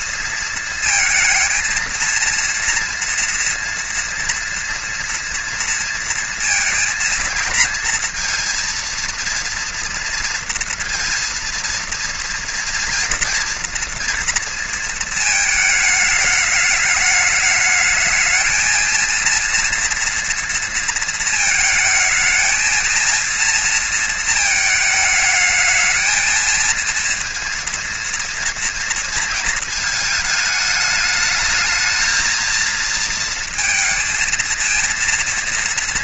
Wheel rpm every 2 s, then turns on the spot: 230, 230, 230, 230, 230, 230, 230, 230, 210, 220, 230, 220, 220, 220, 230, 220, 220, 230.
none